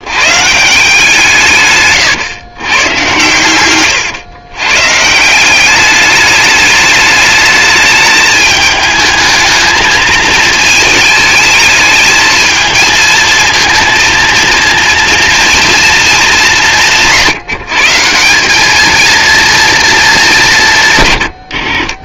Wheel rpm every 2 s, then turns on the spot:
160, 110, 130, 210, 210, 220, 220, 230, 200, 200, 140.
none